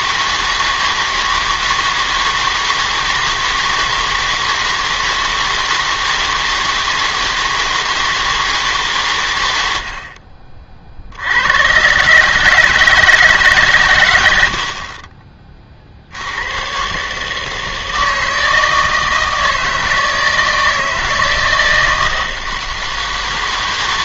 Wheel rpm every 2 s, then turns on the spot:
160, 160, 160, 160, 160, 50, 150, 60, 120, 160, 160, 160.
none